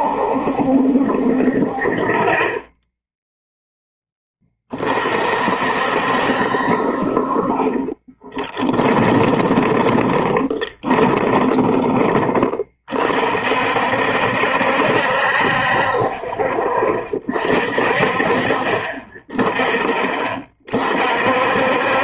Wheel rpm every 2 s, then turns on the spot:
70, 30, 30, 60, 20, 20, 30, 60, 30, 40, 40.
8-12